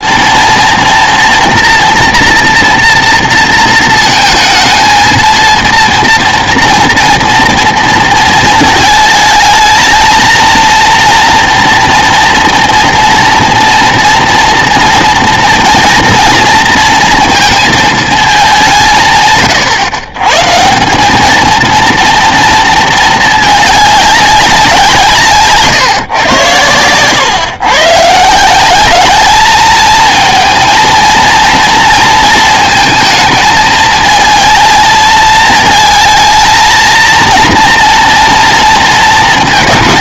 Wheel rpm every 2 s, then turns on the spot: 230, 230, 220, 230, 220, 230, 230, 230, 240, 180, 160, 230, 180, 120, 190, 230, 220, 220, 230, 230.
none